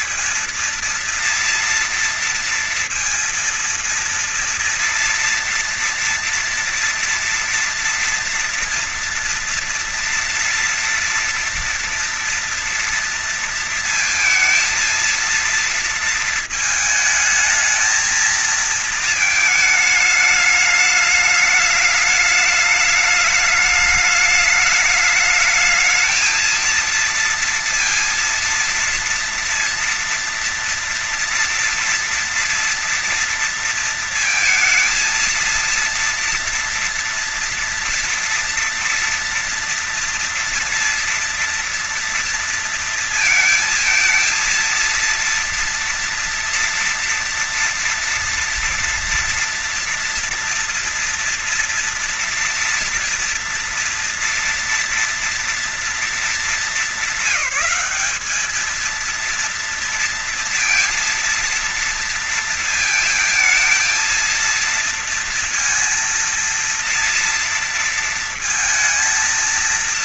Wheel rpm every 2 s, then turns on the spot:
230, 230, 230, 230, 230, 230, 230, 230, 220, 220, 210, 210, 210, 220, 230, 230, 230, 230, 230, 230, 230, 230, 230, 230, 230, 230, 230, 230, 210, 200, 230, 230, 230, 230, 230.
none